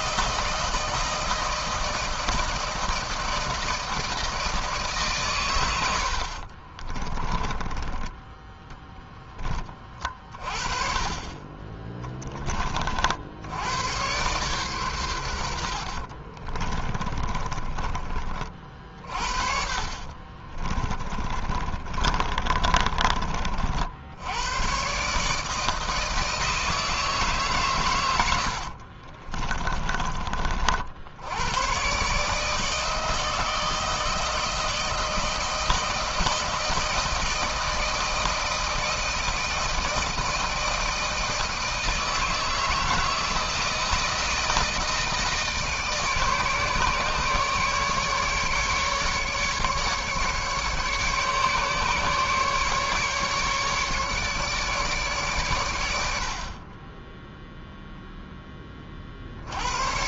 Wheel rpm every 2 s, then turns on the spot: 160, 160, 140, 30, 10, 30, 40, 110, 30, 50, 30, 30, 130, 160, 60, 70, 160, 170, 160, 160, 160, 160, 160, 150, 150, 140, 150, 140, 20, 30.
6-8 16-18 20-22 28-30